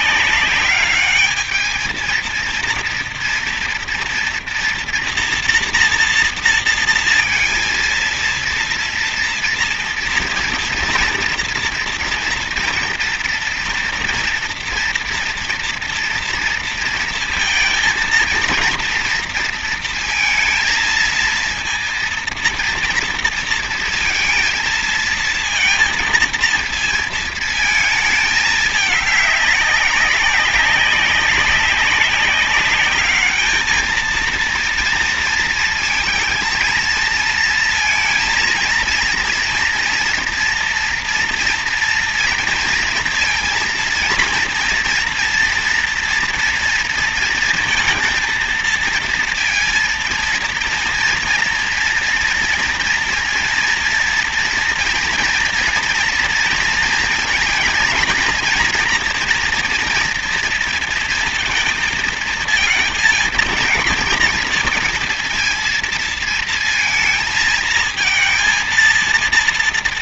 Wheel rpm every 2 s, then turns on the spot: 200, 230, 240, 230, 230, 230, 240, 240, 230, 230, 230, 230, 230, 230, 220, 200, 200, 230, 220, 230, 230, 230, 230, 230, 230, 230, 230, 240, 230, 240, 230, 220, 230, 230, 230.
none